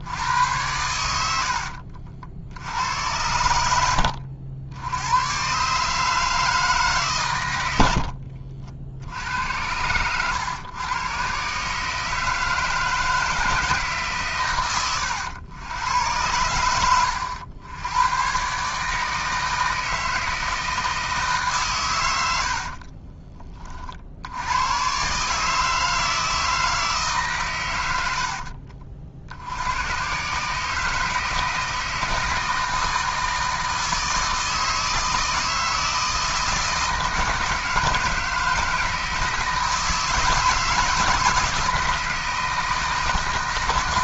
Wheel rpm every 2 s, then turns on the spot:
90, 80, 80, 150, 70, 110, 160, 110, 100, 150, 160, 60, 110, 160, 50, 150, 160, 160, 160, 160, 160, 150.
22-24